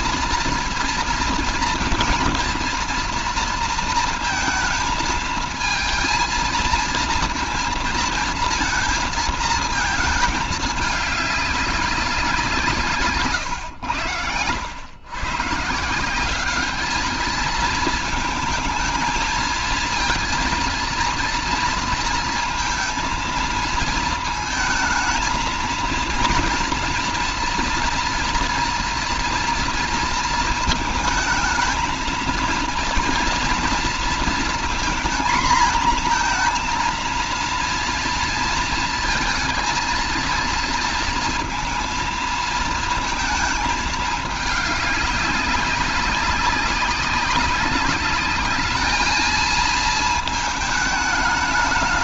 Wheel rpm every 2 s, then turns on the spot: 230, 230, 230, 230, 230, 220, 180, 100, 200, 220, 230, 230, 220, 230, 230, 230, 230, 230, 230, 230, 230, 230, 210, 190, 200, 220.
none